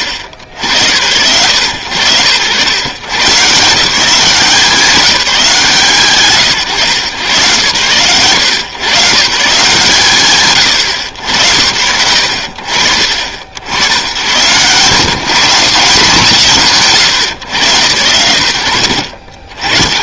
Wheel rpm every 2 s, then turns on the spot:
80, 110, 180, 130, 110, 90, 60, 110, 140, 100.
none